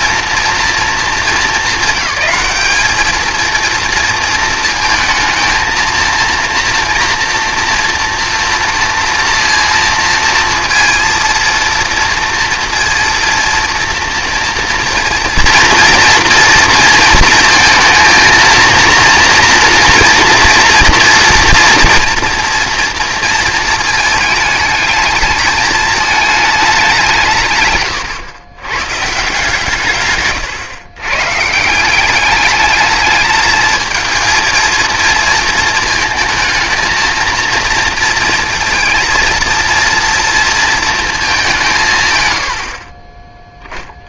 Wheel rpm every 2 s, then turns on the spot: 230, 200, 220, 230, 230, 230, 230, 230, 230, 230, 230, 240, 220, 200, 120, 120, 210, 230, 230, 230, 230, 60.
none